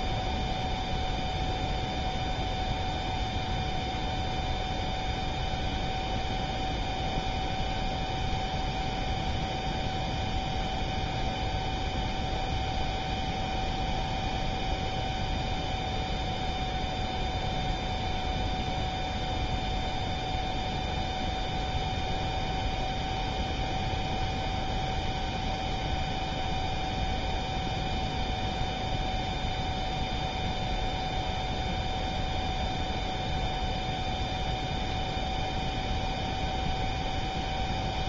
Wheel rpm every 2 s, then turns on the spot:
0, 0, 0, 0, 0, 0, 0, 0, 0, 0, 0, 0, 0, 0, 0, 0, 0, 0, 0.
none